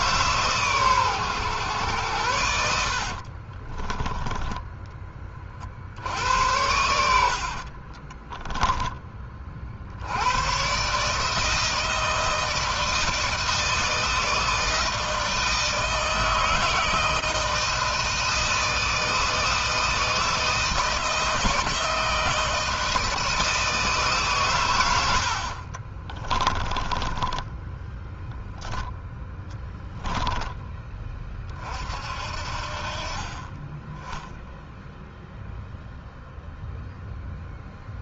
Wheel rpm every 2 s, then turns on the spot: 130, 60, 20, 80, 20, 140, 160, 160, 160, 160, 160, 160, 100, 20, 0, 20, 40, 0, 0.
2-4 6-8 26-28